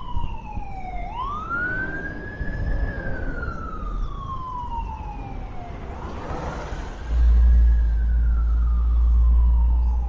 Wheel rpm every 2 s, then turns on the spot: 0, 0, 0, 0, 0.
none